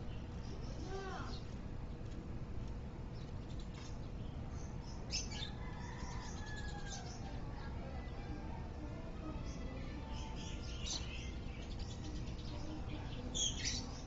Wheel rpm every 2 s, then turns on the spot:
0, 0, 0, 0, 0, 0, 0.
none